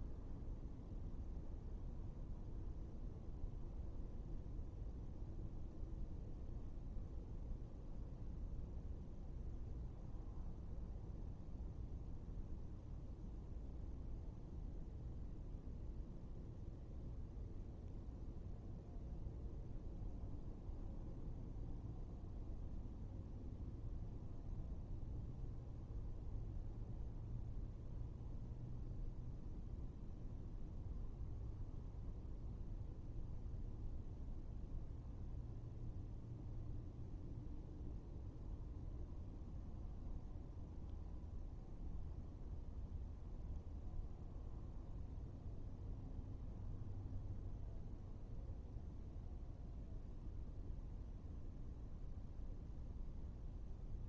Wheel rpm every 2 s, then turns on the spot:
0, 0, 0, 0, 0, 0, 0, 0, 0, 0, 0, 0, 0, 0, 0, 0, 0, 0, 0, 0, 0, 0, 0, 0, 0, 0, 0.
none